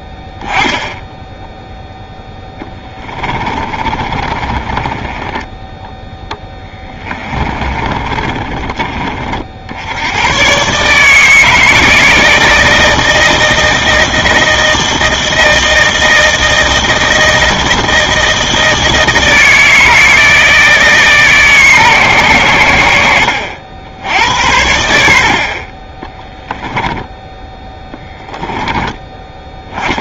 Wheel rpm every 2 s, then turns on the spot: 0, 10, 20, 20, 30, 140, 160, 160, 160, 160, 160, 80, 70, 10, 10.
2-10 26-28